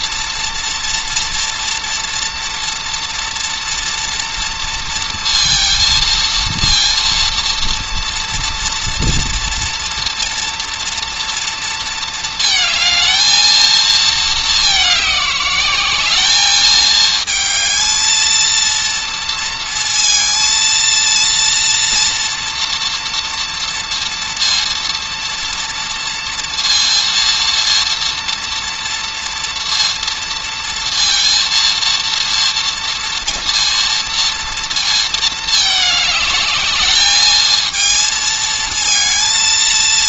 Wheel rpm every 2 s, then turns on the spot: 230, 230, 230, 230, 230, 230, 220, 210, 220, 230, 230, 230, 230, 230, 230, 230, 230, 230, 210, 220.
none